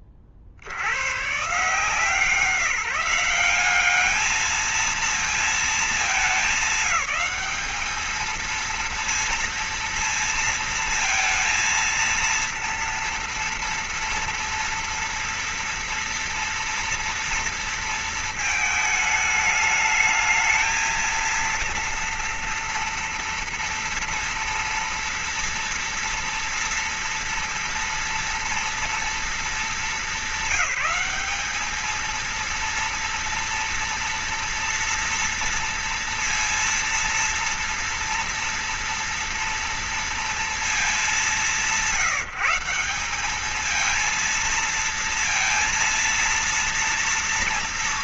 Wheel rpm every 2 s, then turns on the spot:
50, 180, 220, 220, 230, 230, 230, 230, 230, 220, 220, 230, 230, 230, 230, 210, 220, 230, 230, 230, 230, 180, 230, 230.
none